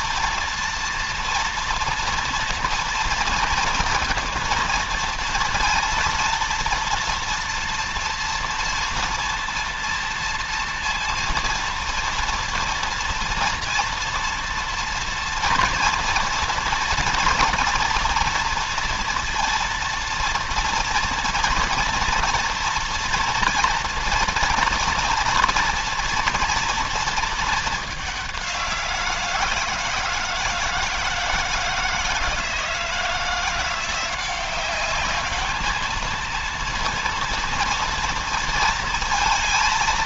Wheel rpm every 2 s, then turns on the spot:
230, 230, 230, 230, 230, 230, 230, 230, 230, 230, 230, 230, 230, 230, 170, 160, 160, 200, 230, 220.
none